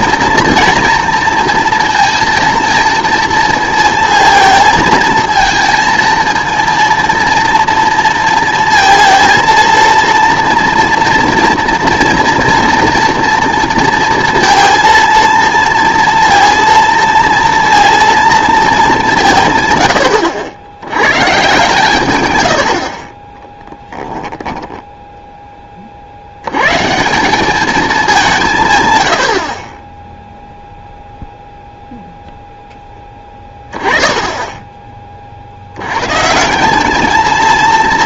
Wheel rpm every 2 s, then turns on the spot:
230, 230, 220, 230, 230, 230, 230, 230, 230, 210, 90, 80, 10, 120, 130, 0, 10, 20, 200.
none